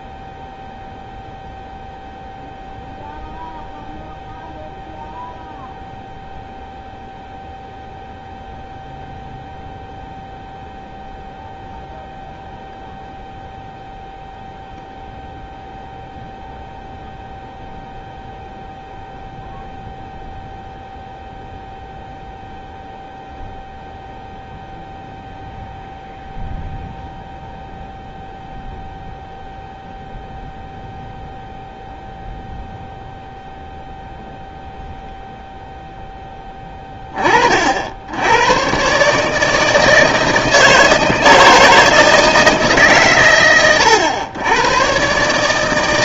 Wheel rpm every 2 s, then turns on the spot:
0, 0, 0, 0, 0, 0, 0, 0, 0, 0, 0, 0, 0, 0, 0, 0, 0, 0, 20, 120, 160, 150, 120.
none